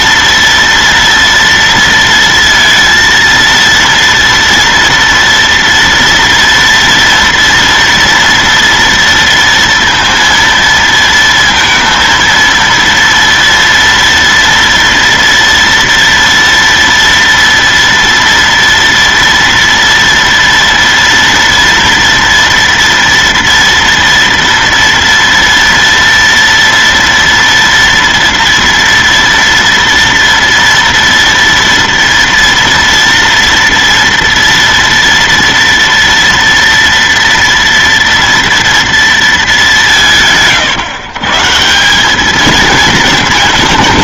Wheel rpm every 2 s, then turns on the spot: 230, 230, 230, 230, 230, 230, 230, 230, 230, 230, 230, 230, 230, 230, 230, 230, 230, 230, 230, 230, 150, 210.
none